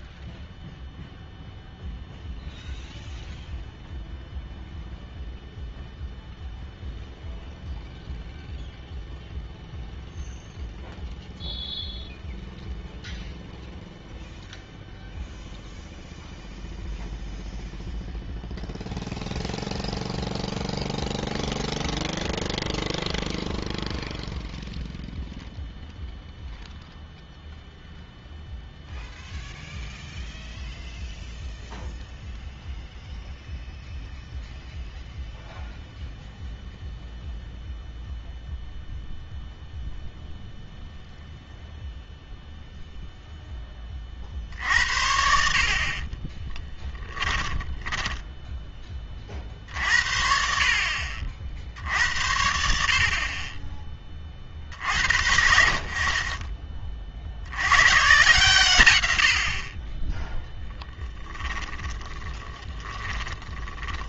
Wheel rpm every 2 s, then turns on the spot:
0, 0, 0, 0, 0, 0, 0, 0, 0, 0, 0, 0, 0, 0, 0, 0, 0, 0, 0, 0, 0, 0, 60, 10, 20, 60, 70, 60, 20, 130, 10, 20.
46-48 62-64